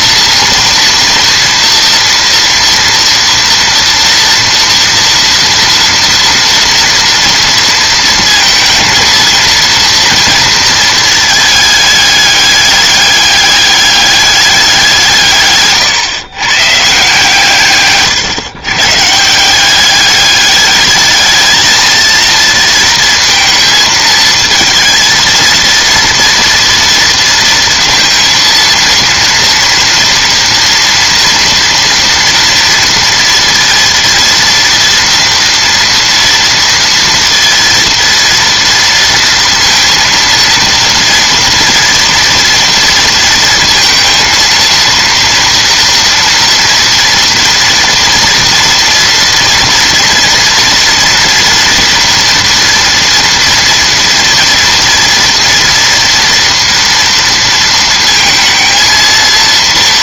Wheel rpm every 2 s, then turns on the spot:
230, 230, 230, 230, 230, 230, 200, 180, 140, 120, 210, 230, 220, 230, 230, 230, 230, 240, 230, 230, 230, 230, 230, 230, 230, 230, 230, 230, 230, 220.
none